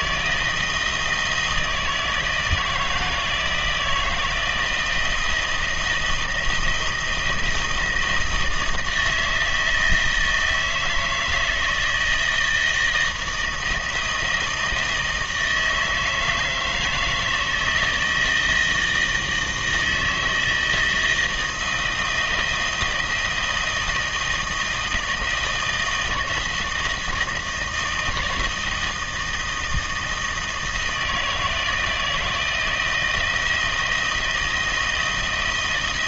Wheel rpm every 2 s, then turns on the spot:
160, 160, 170, 160, 160, 160, 160, 160, 160, 160, 160, 160, 160, 160, 160, 160, 160, 160.
none